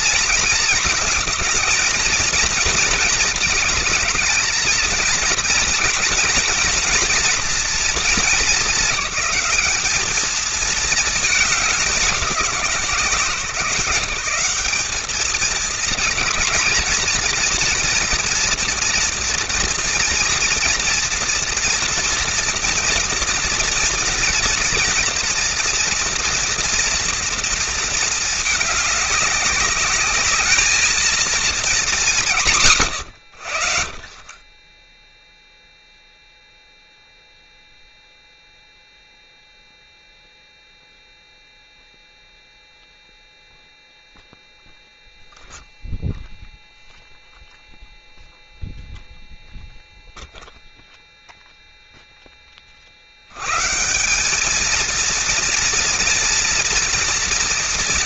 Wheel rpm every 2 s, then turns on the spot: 230, 230, 230, 230, 190, 220, 160, 190, 230, 240, 230, 230, 230, 230, 210, 220, 120, 10, 0, 0, 0, 0, 0, 0, 0, 0, 30, 210, 230.
none